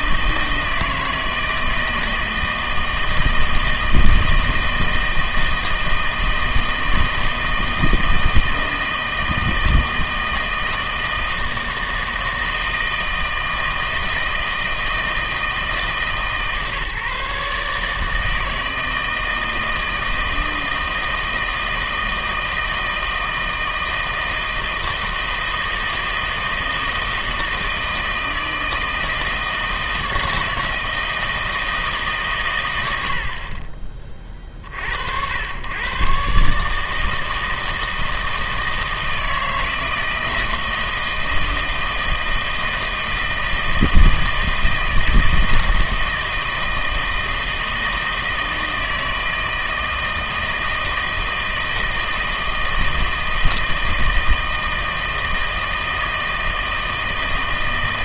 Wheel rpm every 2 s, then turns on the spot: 160, 160, 160, 160, 160, 160, 160, 160, 140, 160, 160, 160, 160, 160, 160, 160, 100, 50, 150, 160, 160, 160, 160, 160, 160, 160, 160, 160, 160.
none